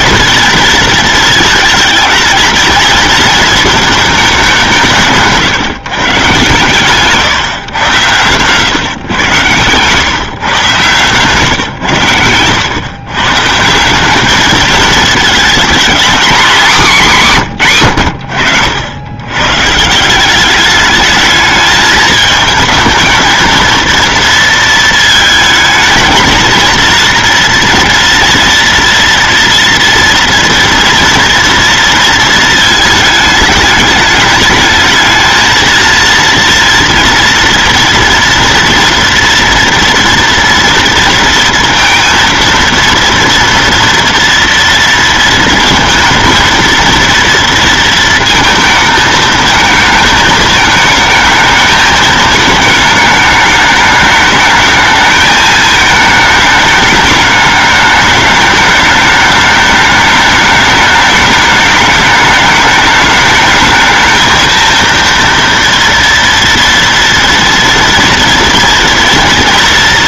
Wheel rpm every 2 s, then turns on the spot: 220, 220, 180, 130, 130, 130, 120, 210, 220, 80, 210, 220, 220, 230, 230, 230, 220, 220, 230, 230, 230, 230, 230, 230, 220, 220, 220, 220, 210, 210, 210, 210, 230, 230, 230.
none